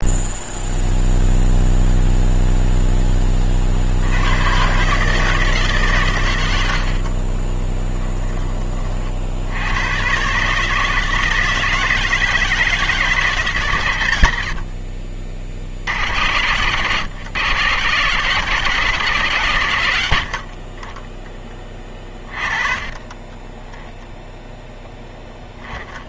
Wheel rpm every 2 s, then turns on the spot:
0, 10, 130, 70, 40, 150, 170, 60, 120, 160, 20, 20, 0.
6-8 22-24